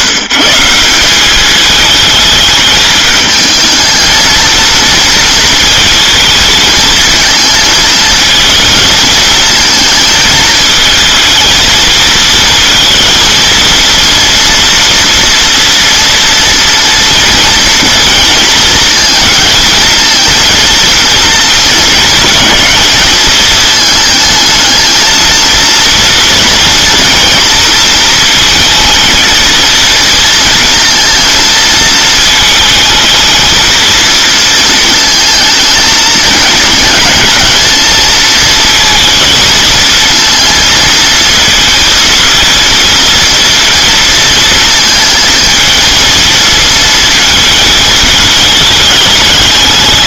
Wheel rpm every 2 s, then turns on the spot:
150, 220, 230, 220, 220, 220, 230, 240, 230, 230, 230, 220, 220, 240, 220, 230, 220, 220, 220, 230, 230, 230, 220, 220, 210.
none